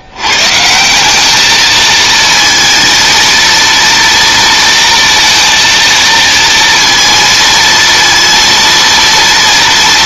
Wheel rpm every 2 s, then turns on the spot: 100, 230, 230, 230, 230.
none